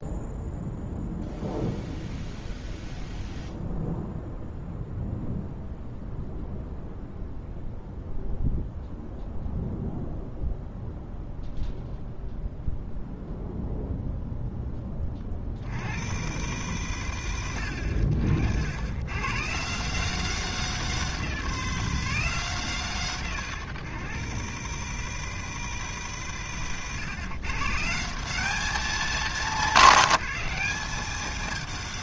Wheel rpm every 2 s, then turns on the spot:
0, 0, 0, 0, 0, 0, 0, 10, 130, 70, 160, 140, 140, 120, 190, 180.
none